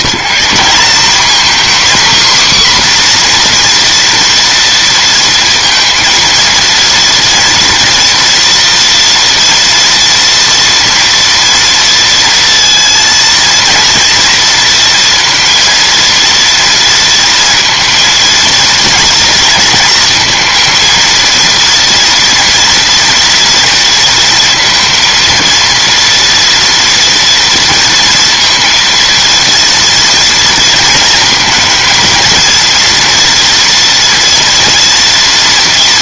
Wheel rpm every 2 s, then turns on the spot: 210, 260, 230, 230, 240, 240, 230, 230, 230, 230, 230, 240, 230, 230, 230, 230, 230, 230.
none